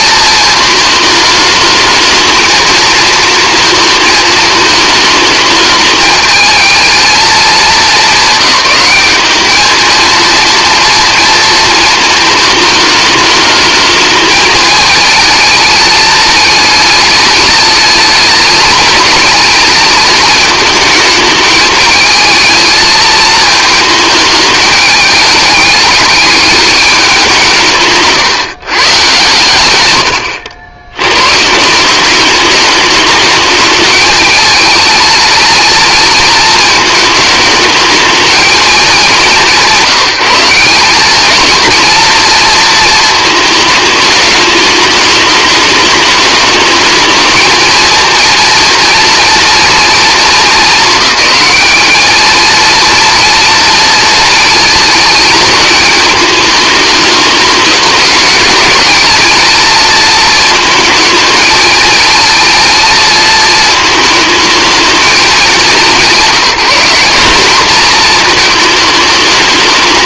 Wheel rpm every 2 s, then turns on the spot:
210, 230, 220, 220, 200, 230, 220, 220, 220, 230, 220, 220, 210, 200, 120, 90, 210, 230, 220, 200, 200, 230, 210, 220, 230, 210, 230, 220, 210, 220, 220, 230, 220, 180, 220.
none